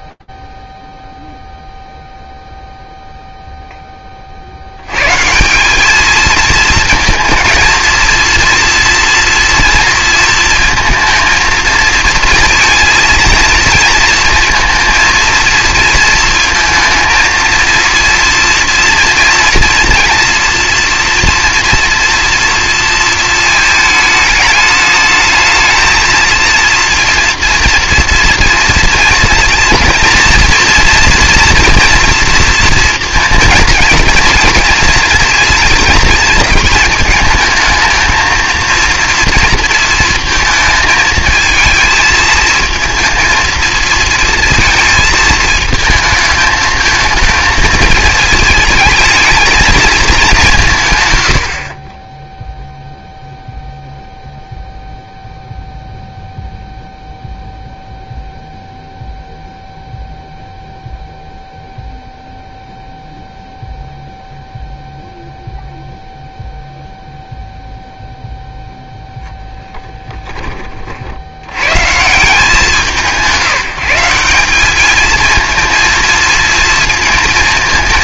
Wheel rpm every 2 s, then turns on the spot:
0, 0, 100, 220, 230, 230, 230, 230, 220, 230, 230, 230, 220, 230, 230, 230, 230, 230, 220, 230, 220, 230, 220, 230, 220, 140, 0, 0, 0, 0, 0, 0, 0, 0, 10, 90, 170, 220, 230.
68-70